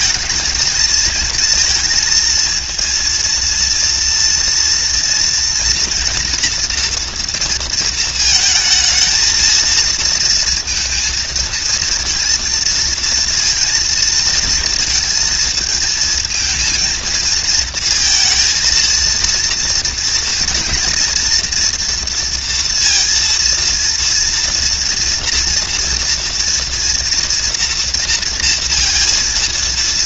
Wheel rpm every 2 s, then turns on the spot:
220, 230, 240, 230, 220, 230, 230, 230, 220, 230, 230, 230, 230, 230, 230.
none